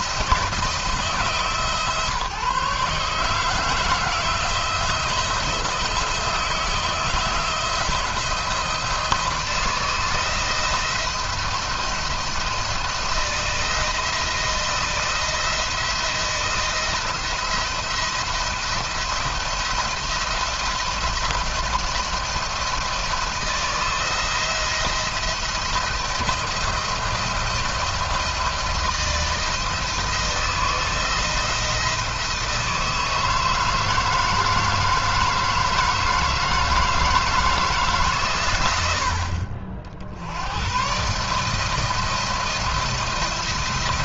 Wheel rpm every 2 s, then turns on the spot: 160, 150, 170, 160, 160, 170, 170, 160, 170, 170, 170, 170, 160, 170, 170, 160, 160, 160, 160, 100, 100, 160.
none